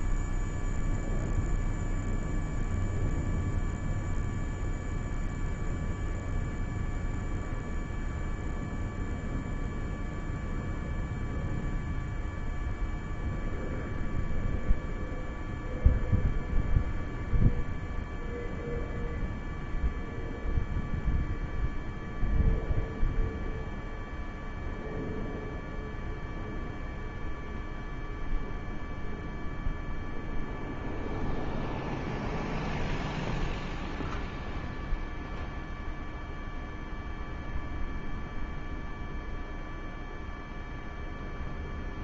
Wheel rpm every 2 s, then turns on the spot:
0, 0, 0, 0, 0, 0, 0, 0, 0, 0, 0, 0, 0, 0, 0, 0, 0, 0, 0, 0, 0.
none